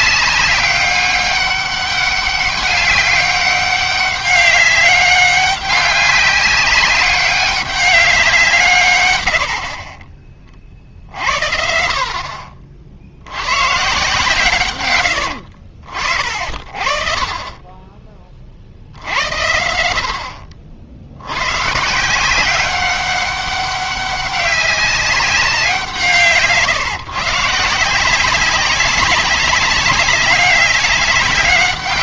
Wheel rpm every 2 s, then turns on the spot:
200, 200, 200, 190, 160, 50, 50, 120, 40, 60, 50, 190, 200, 150, 190, 200.
none